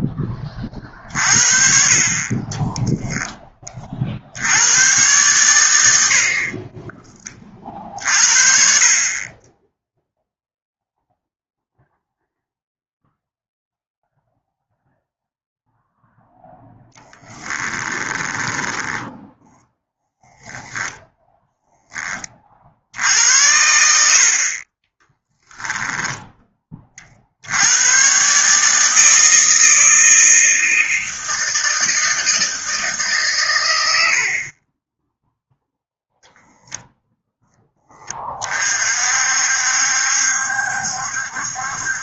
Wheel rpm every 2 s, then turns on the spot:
40, 10, 110, 50, 30, 0, 0, 0, 10, 10, 0, 70, 20, 50, 160, 160, 150, 10, 0, 50, 70.
16-20 24-26